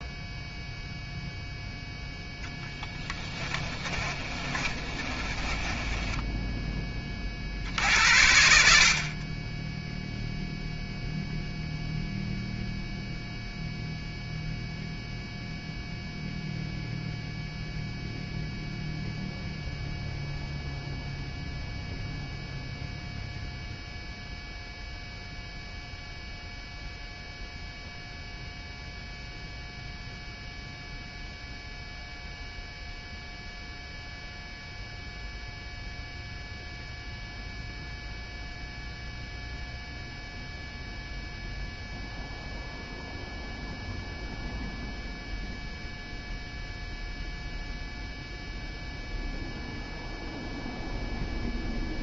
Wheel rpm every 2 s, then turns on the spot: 0, 10, 30, 10, 70, 0, 0, 0, 0, 0, 0, 0, 0, 0, 0, 0, 0, 0, 0, 0, 0, 0, 0, 0, 0, 0.
2-6